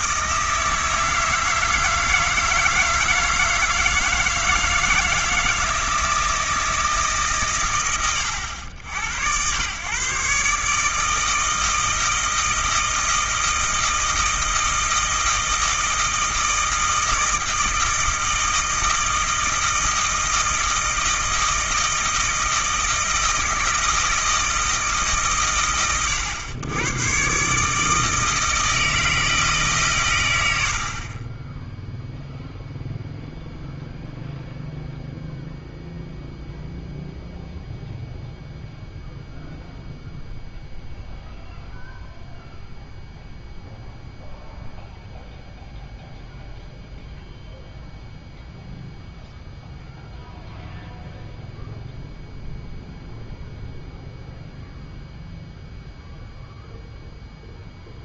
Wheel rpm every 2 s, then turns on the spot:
160, 160, 160, 160, 90, 140, 160, 160, 160, 160, 160, 160, 160, 90, 160, 90, 0, 0, 0, 0, 0, 0, 0, 0, 0, 0, 0, 0, 0.
none